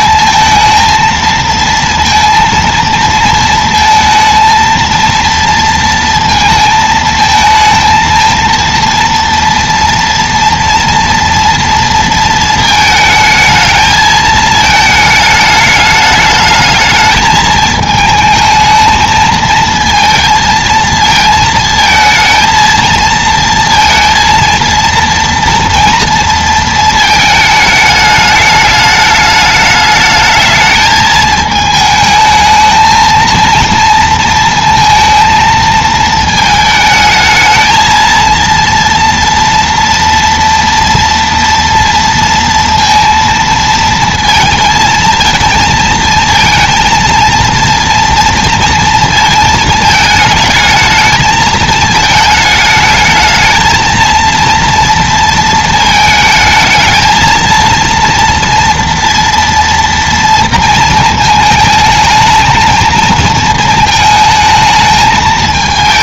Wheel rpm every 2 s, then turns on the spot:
220, 230, 230, 220, 230, 230, 220, 220, 220, 220, 220, 220, 230, 230, 210, 220, 220, 230, 220, 230, 230, 230, 230, 230, 230, 220, 220, 230, 220, 230, 230, 220, 220.
none